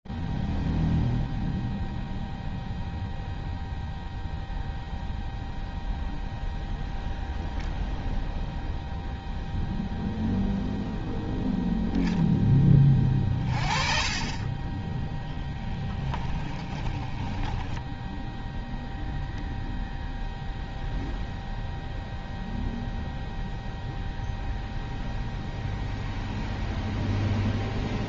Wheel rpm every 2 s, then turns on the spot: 0, 0, 0, 0, 0, 0, 20, 10, 10, 0, 0, 0, 0, 0.
14-18